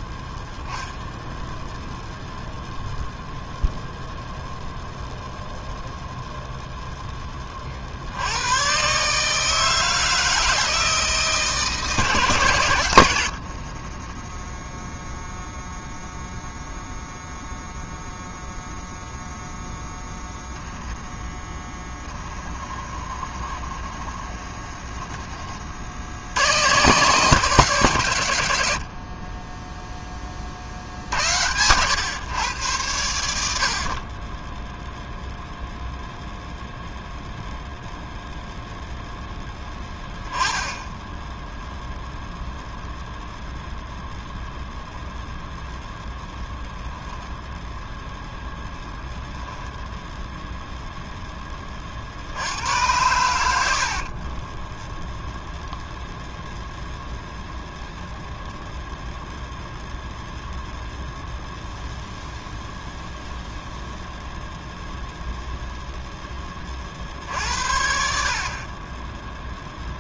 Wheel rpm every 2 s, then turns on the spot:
0, 0, 0, 0, 150, 160, 100, 0, 0, 0, 10, 30, 20, 140, 30, 70, 90, 0, 0, 0, 0, 0, 0, 0, 0, 0, 100, 10, 0, 0, 0, 0, 0, 30, 30.
22-24 54-56